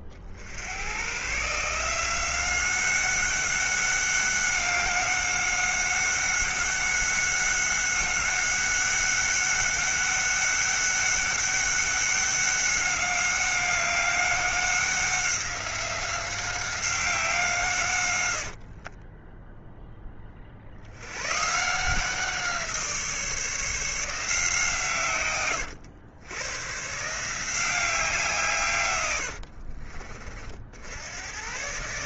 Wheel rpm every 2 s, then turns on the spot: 110, 190, 190, 190, 190, 200, 200, 190, 190, 40, 80, 160, 140, 140, 130, 80.
18-20 28-30